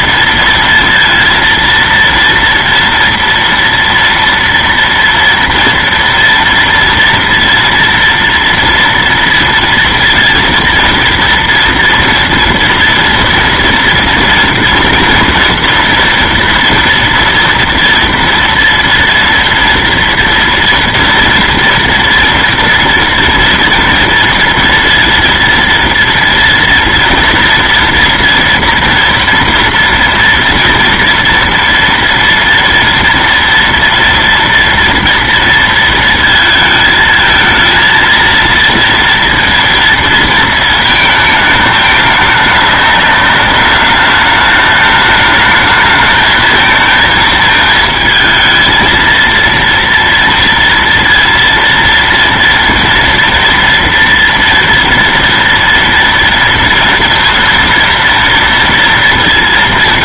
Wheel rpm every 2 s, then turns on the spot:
230, 230, 230, 230, 230, 230, 230, 240, 240, 240, 230, 230, 230, 230, 230, 230, 230, 230, 220, 230, 220, 210, 210, 220, 230, 230, 230, 230, 230, 230.
none